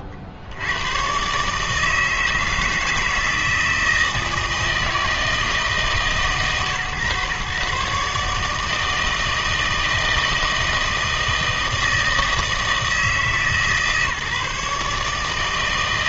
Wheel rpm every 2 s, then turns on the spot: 60, 160, 160, 130, 160, 160, 160, 150.
none